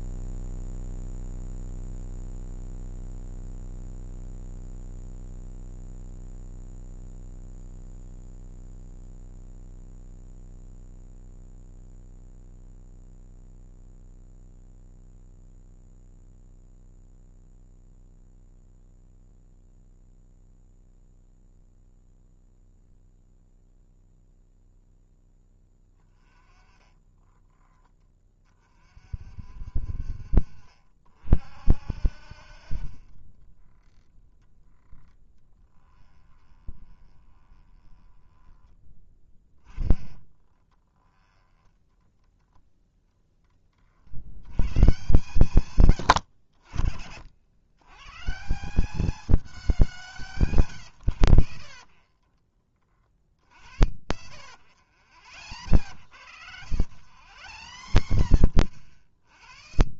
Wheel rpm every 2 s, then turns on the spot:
0, 0, 0, 0, 0, 0, 0, 0, 0, 0, 0, 0, 0, 20, 30, 50, 40, 10, 20, 10, 10, 0, 100, 80, 170, 150, 40, 80, 90, 60.
26-28 36-42 50-52 54-60